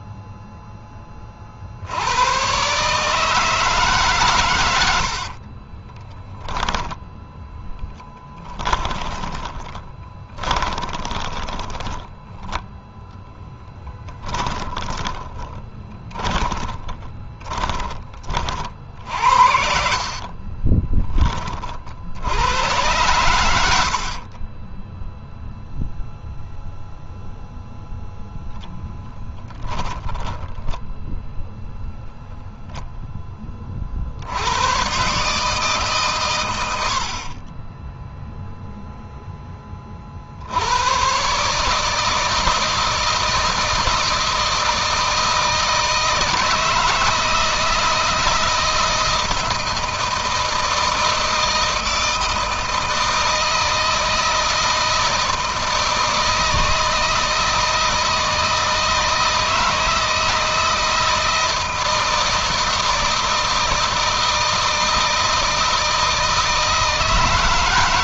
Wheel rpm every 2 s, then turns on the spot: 10, 130, 80, 0, 20, 20, 10, 40, 20, 50, 20, 100, 10, 0, 10, 10, 0, 110, 90, 0, 100, 160, 160, 160, 160, 160, 160, 160, 160, 160, 160, 160, 160, 160.
8-12 14-18 20-22 24-26 30-32